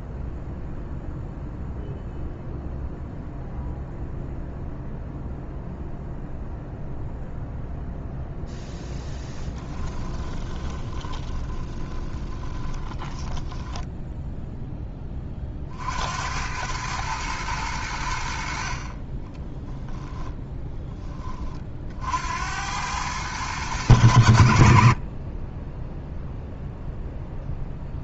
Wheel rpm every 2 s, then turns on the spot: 0, 0, 0, 0, 0, 30, 10, 10, 110, 40, 10, 90, 50, 0.
10-14